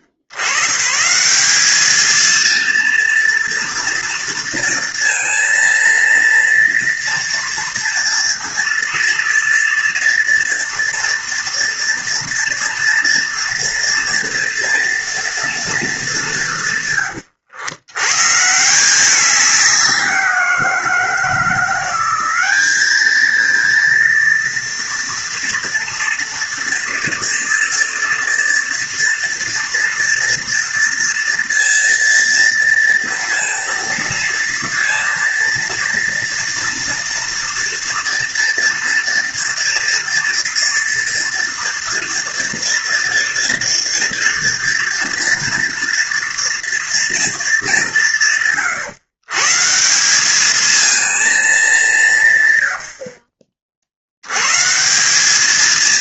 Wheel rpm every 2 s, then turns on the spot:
50, 230, 230, 230, 230, 230, 230, 230, 190, 150, 180, 190, 230, 240, 230, 230, 230, 230, 230, 230, 230, 230, 240, 230, 140, 210, 140, 120.
none